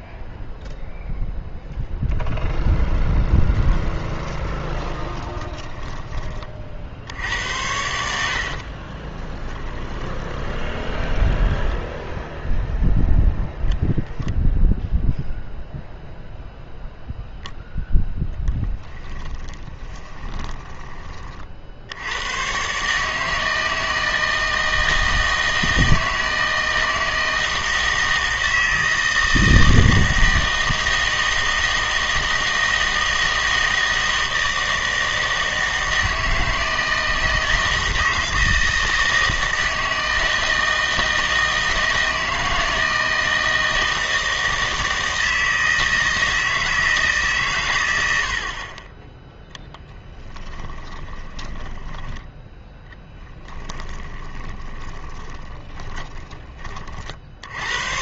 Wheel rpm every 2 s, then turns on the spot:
0, 0, 20, 50, 40, 20, 0, 0, 0, 20, 20, 130, 160, 160, 160, 160, 160, 160, 160, 160, 160, 160, 160, 160, 40, 20, 10, 20, 40.
4-6 8-12 18-22 50-52 54-56